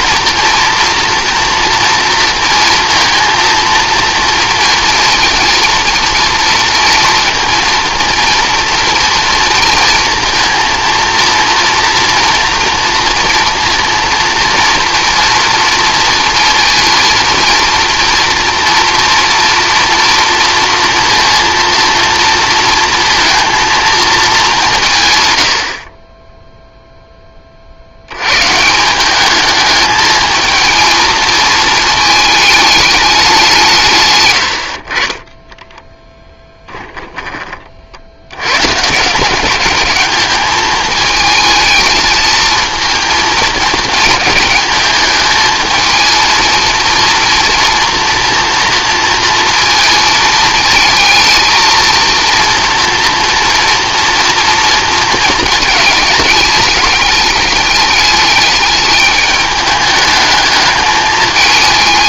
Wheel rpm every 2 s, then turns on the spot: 230, 230, 230, 230, 240, 230, 230, 230, 230, 230, 230, 230, 160, 0, 170, 220, 210, 50, 10, 140, 210, 230, 220, 230, 230, 220, 240, 230, 210, 210, 220.
none